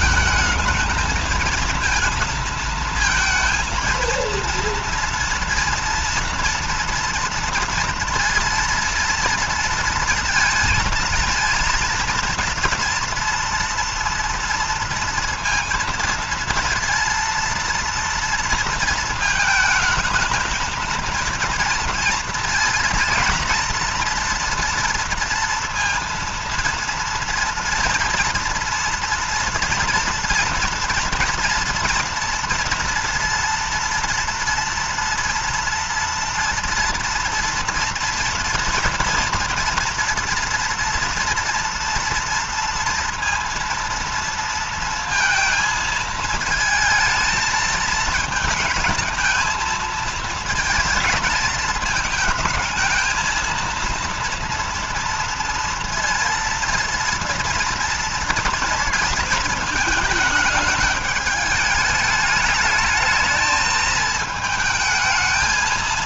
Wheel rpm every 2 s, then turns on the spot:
220, 220, 230, 230, 230, 230, 230, 230, 230, 230, 220, 230, 230, 230, 230, 230, 230, 230, 230, 230, 230, 230, 230, 220, 230, 220, 220, 230, 230, 230, 210, 220, 220.
none